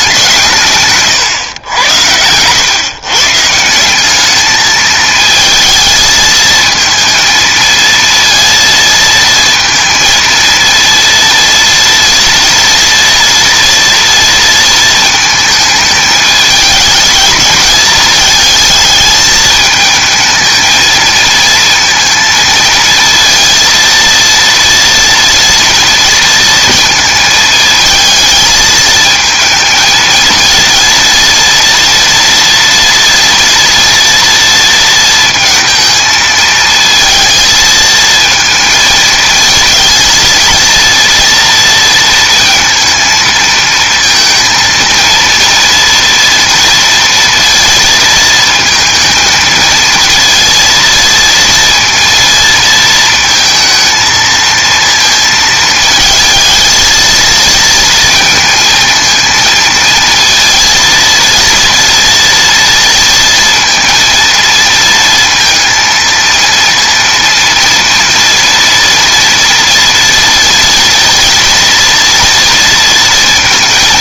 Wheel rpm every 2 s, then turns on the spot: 140, 120, 220, 230, 230, 230, 230, 230, 220, 220, 220, 230, 230, 220, 220, 230, 230, 230, 220, 220, 230, 230, 230, 230, 230, 230, 230, 230, 220, 230, 230, 230, 230, 230, 240, 230, 230.
none